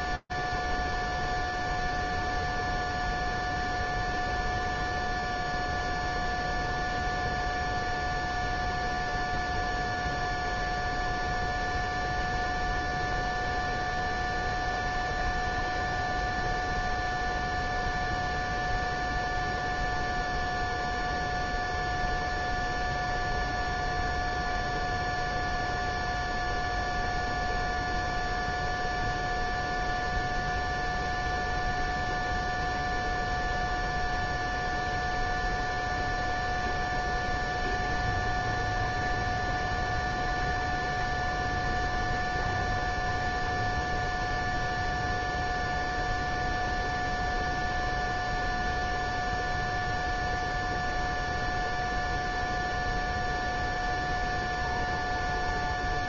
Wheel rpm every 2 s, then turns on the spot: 0, 0, 0, 0, 0, 0, 0, 0, 0, 0, 0, 0, 0, 0, 0, 0, 0, 0, 0, 0, 0, 0, 0, 0, 0, 0, 0, 0.
none